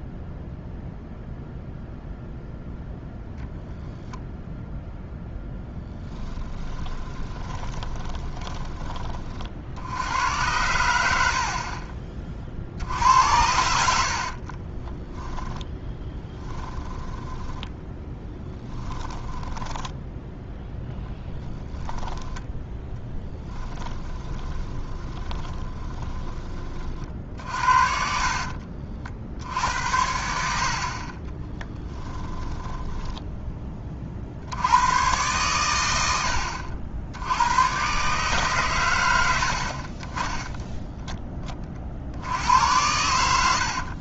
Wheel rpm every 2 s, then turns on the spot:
0, 0, 0, 20, 20, 90, 60, 20, 10, 10, 10, 10, 20, 30, 50, 60, 20, 100, 70, 110, 10, 90.
6-8 14-26 32-34